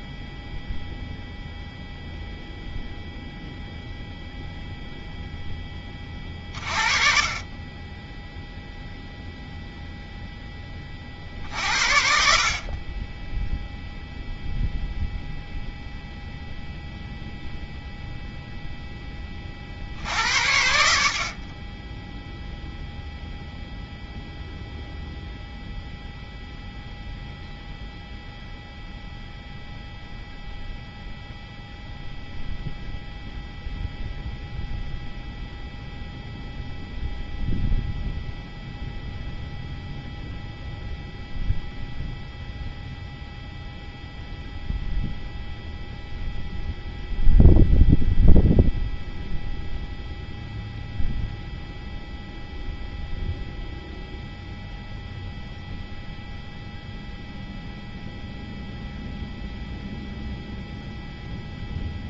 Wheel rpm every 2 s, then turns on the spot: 0, 0, 0, 30, 0, 50, 10, 0, 0, 20, 60, 0, 0, 0, 0, 0, 0, 0, 0, 0, 0, 0, 0, 0, 0, 0, 0, 0, 0, 0, 0.
none